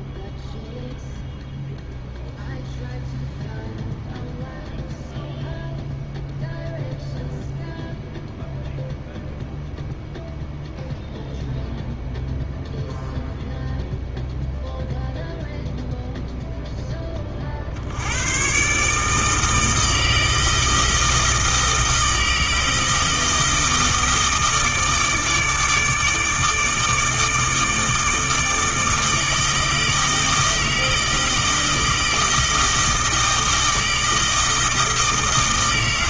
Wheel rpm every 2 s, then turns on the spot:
0, 0, 0, 0, 0, 0, 0, 0, 10, 140, 160, 160, 160, 160, 160, 160, 160, 160.
none